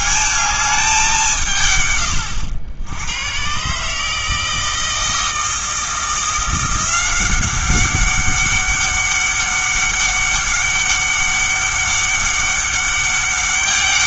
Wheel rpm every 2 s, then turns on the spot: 210, 90, 160, 180, 200, 200, 200.
none